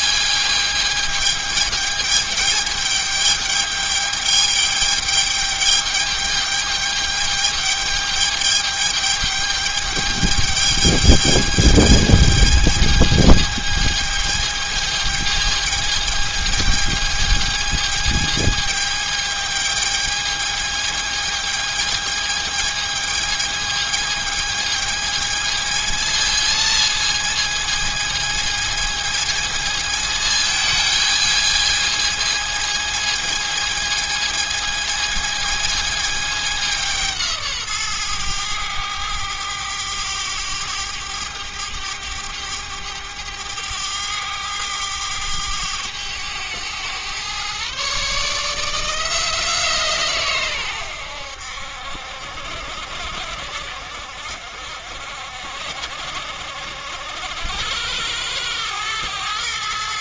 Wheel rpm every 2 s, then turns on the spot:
210, 210, 210, 210, 210, 210, 220, 220, 220, 220, 220, 220, 220, 220, 220, 220, 220, 220, 170, 100, 100, 100, 100, 110, 160, 90, 60, 60, 80, 110.
none